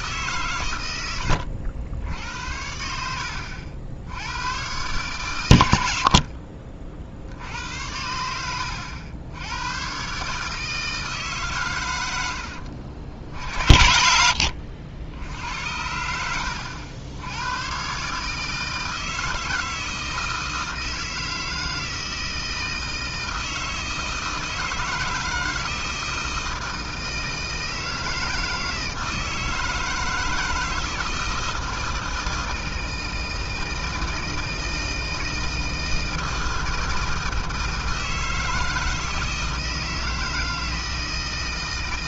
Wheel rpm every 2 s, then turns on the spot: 120, 80, 110, 60, 90, 160, 70, 70, 70, 160, 160, 160, 160, 160, 160, 160, 160, 160, 160, 160, 160.
none